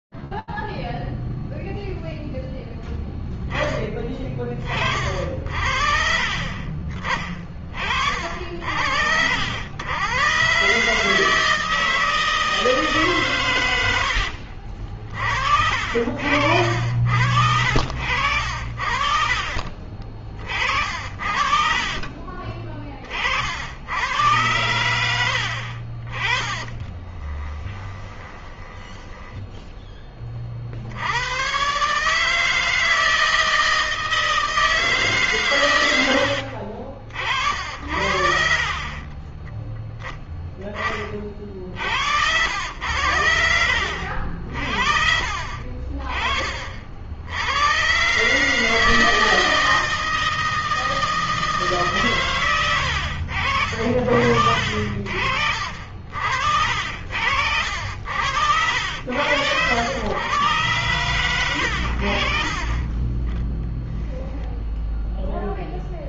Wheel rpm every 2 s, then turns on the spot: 0, 10, 40, 40, 90, 160, 120, 50, 70, 40, 60, 40, 80, 20, 10, 110, 160, 140, 50, 20, 40, 70, 50, 70, 160, 160, 90, 50, 70, 80, 110, 10, 0.
16-18 20-22 26-28 36-38 60-62